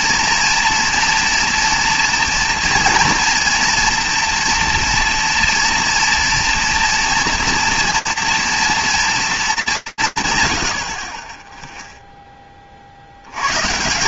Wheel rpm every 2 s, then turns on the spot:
230, 230, 230, 230, 230, 100, 30.
none